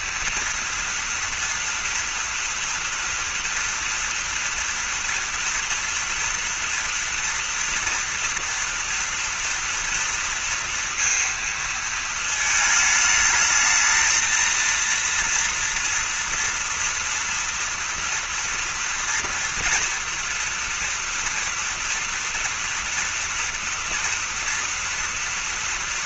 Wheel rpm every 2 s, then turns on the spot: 230, 230, 230, 240, 230, 230, 220, 230, 240, 230, 230, 230, 230.
none